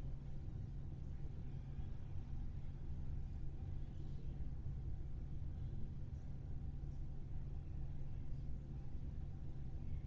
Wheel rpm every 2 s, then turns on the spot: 0, 0, 0, 0, 0.
none